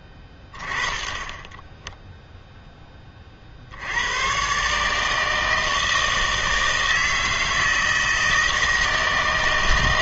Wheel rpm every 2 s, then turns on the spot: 20, 10, 140, 160, 160.
none